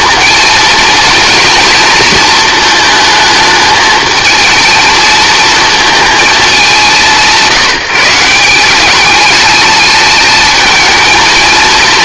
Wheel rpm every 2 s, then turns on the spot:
230, 220, 230, 200, 190, 220.
none